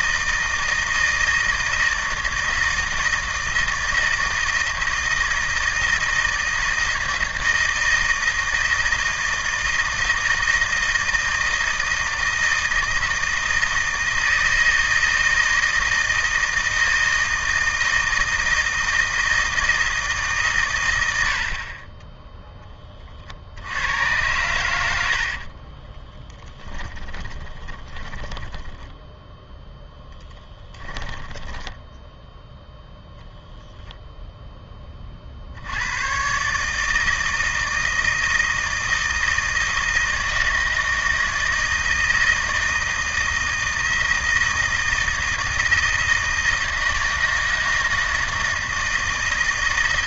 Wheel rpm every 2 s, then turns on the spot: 160, 160, 160, 160, 160, 160, 160, 160, 160, 160, 130, 10, 90, 10, 10, 10, 0, 10, 140, 160, 160, 160, 160, 160, 160.
26-32